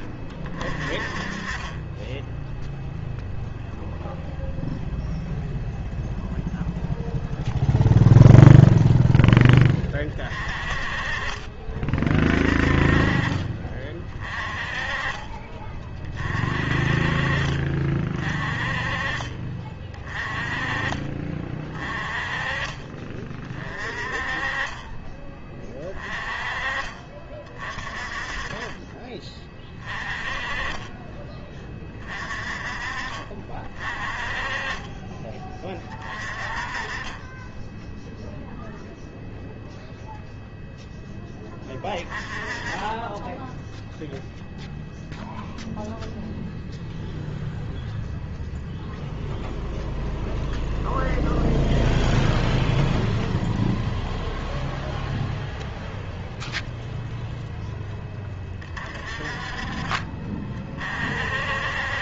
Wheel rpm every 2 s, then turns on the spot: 30, 0, 0, 0, 0, 30, 30, 30, 40, 30, 30, 30, 30, 30, 30, 20, 40, 30, 30, 0, 0, 10, 0, 0, 0, 0, 0, 0, 0, 30, 40.
none